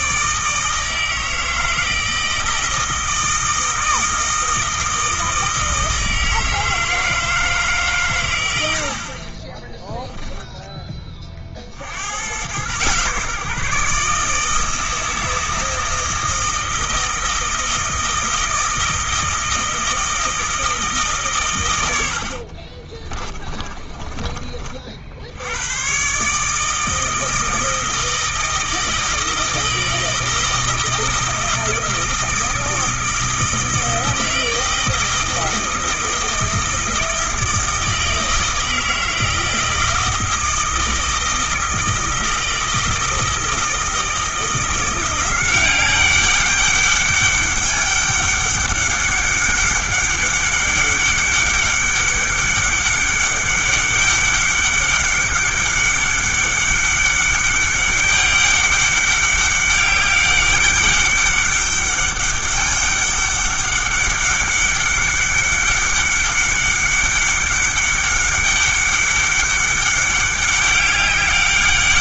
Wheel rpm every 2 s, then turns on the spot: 160, 160, 160, 160, 60, 20, 130, 160, 160, 160, 160, 30, 50, 160, 160, 160, 160, 160, 160, 160, 160, 160, 170, 200, 200, 200, 200, 200, 200, 200, 200, 200, 200, 200, 200, 200.
8-10 22-24